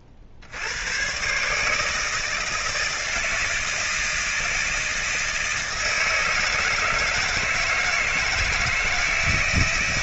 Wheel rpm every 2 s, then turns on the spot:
80, 160, 160, 160, 160.
none